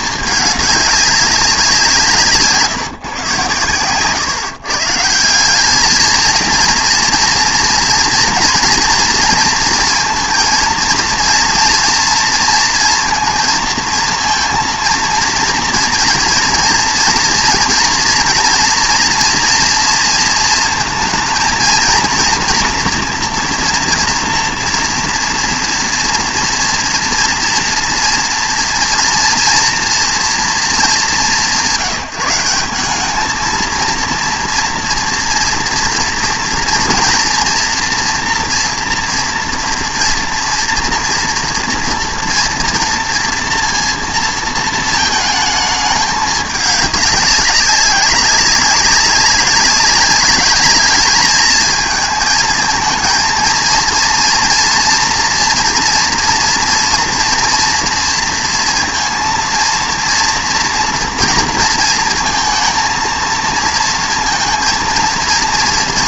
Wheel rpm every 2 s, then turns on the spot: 200, 140, 140, 230, 240, 230, 230, 230, 230, 230, 230, 230, 230, 230, 230, 220, 190, 230, 230, 230, 240, 230, 230, 210, 190, 210, 220, 230, 240, 230, 230, 220, 230.
none